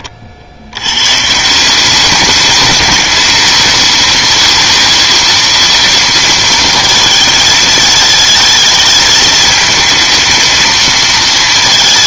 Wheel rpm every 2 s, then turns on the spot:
100, 210, 230, 220, 220, 230.
none